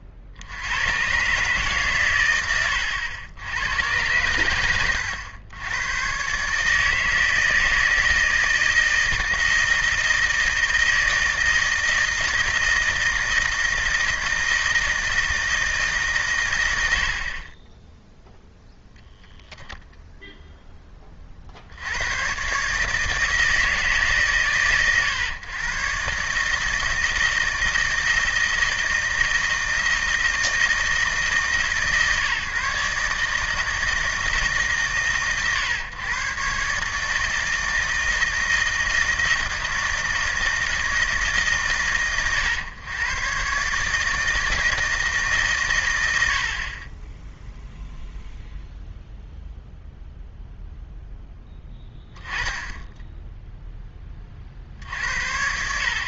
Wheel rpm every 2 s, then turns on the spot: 100, 100, 100, 160, 160, 160, 160, 160, 80, 0, 10, 150, 110, 160, 160, 160, 150, 120, 150, 160, 160, 120, 160, 30, 0, 0, 10, 70.
none